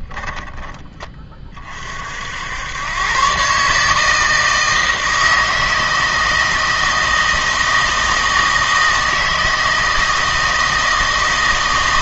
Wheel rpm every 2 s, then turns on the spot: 10, 90, 160, 160, 160, 160.
none